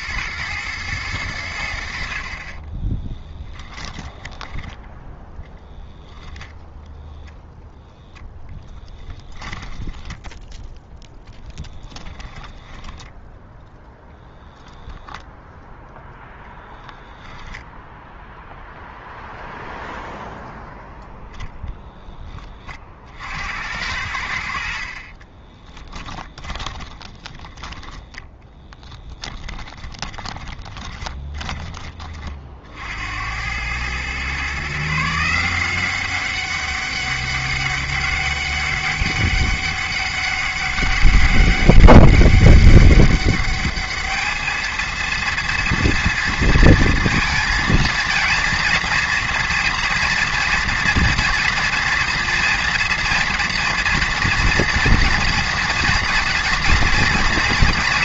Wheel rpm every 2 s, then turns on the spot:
110, 30, 10, 10, 10, 0, 10, 10, 10, 0, 0, 40, 50, 20, 10, 10, 60, 140, 200, 200, 200, 200, 220, 230, 230, 230, 230, 240, 230.
2-6 8-10 12-14 16-18 26-32